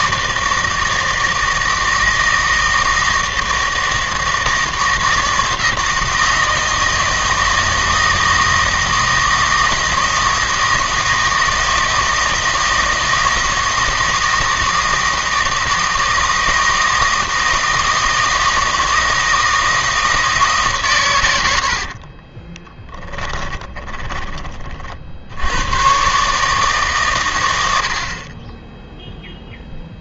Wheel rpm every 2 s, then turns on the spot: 160, 160, 160, 160, 160, 160, 160, 160, 160, 160, 130, 10, 50, 140, 0.
22-24